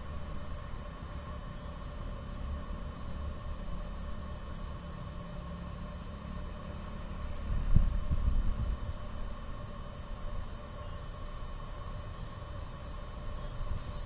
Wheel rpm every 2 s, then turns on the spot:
0, 0, 0, 0, 0, 0, 0.
none